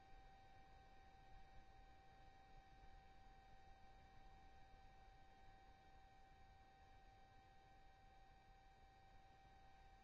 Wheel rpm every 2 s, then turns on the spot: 0, 0, 0, 0, 0.
none